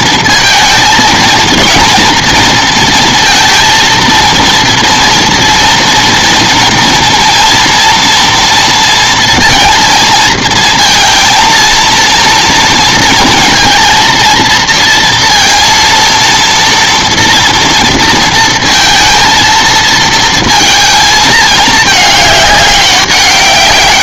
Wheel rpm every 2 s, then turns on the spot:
230, 230, 230, 230, 230, 230, 230, 230, 230, 230, 230, 200.
none